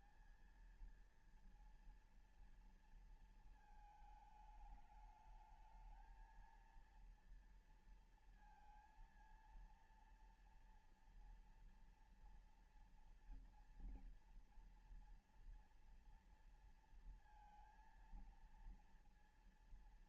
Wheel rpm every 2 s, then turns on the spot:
220, 230, 220, 220, 230, 230, 230, 240, 230, 230.
none